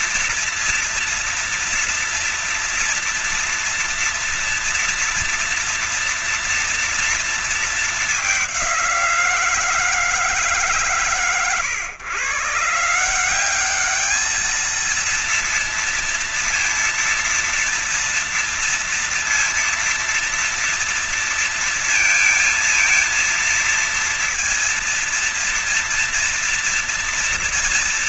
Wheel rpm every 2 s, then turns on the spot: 230, 230, 230, 230, 200, 150, 140, 210, 230, 230, 230, 230, 230, 230.
none